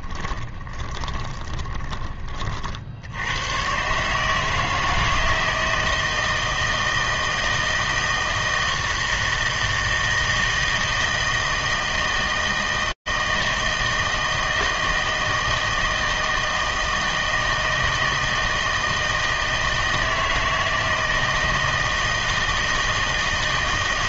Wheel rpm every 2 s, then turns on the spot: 20, 50, 160, 160, 160, 160, 160, 160, 160, 160, 160, 160.
0-2